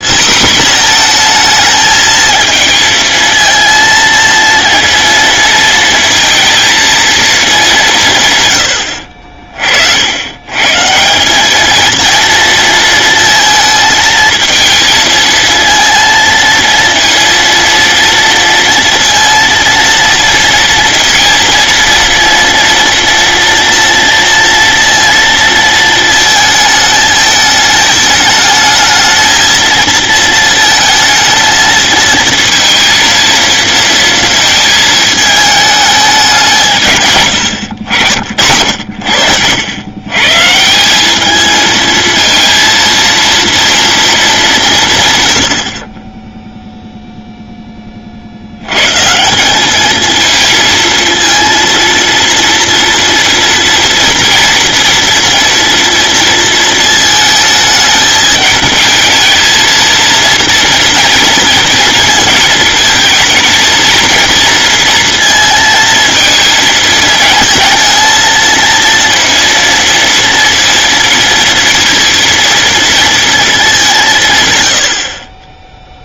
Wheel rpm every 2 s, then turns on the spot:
240, 230, 230, 230, 80, 150, 230, 220, 230, 230, 230, 230, 230, 220, 220, 220, 230, 220, 150, 80, 170, 230, 150, 0, 110, 230, 230, 230, 220, 220, 230, 220, 230, 230, 230, 230, 230, 150.
none